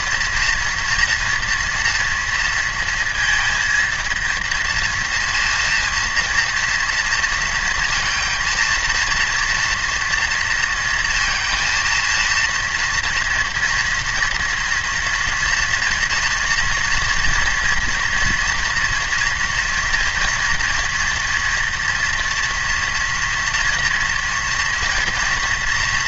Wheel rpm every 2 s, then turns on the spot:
230, 230, 230, 230, 230, 230, 230, 230, 230, 240, 240, 240, 230.
none